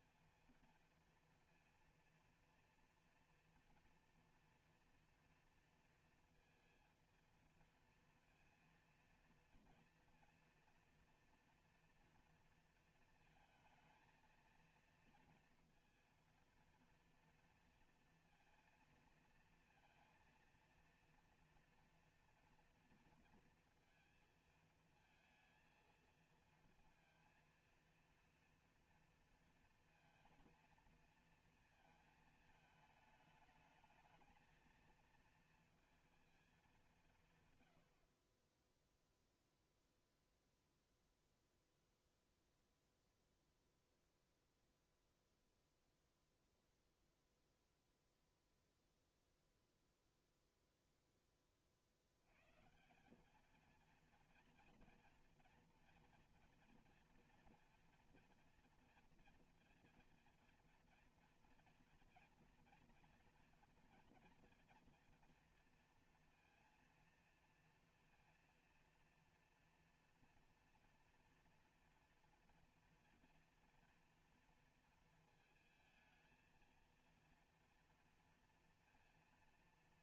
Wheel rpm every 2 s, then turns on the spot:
230, 230, 240, 230, 230, 230, 220, 230, 230, 230, 230, 240, 230, 230, 230, 230, 220, 220, 210, 10, 0, 0, 0, 0, 0, 0, 140, 230, 230, 230, 230, 230, 230, 230, 230, 240, 230, 230, 220, 230.
none